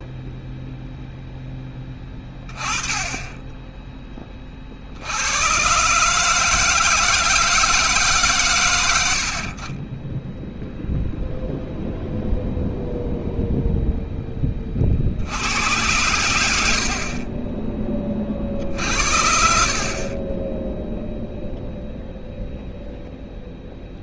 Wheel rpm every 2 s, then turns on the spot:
0, 10, 40, 160, 130, 10, 0, 20, 90, 50, 20, 0.
none